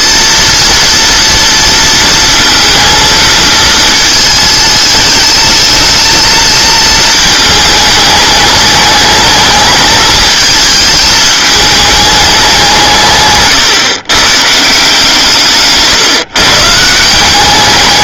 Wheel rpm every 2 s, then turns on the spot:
230, 230, 220, 230, 210, 220, 170, 160, 150.
none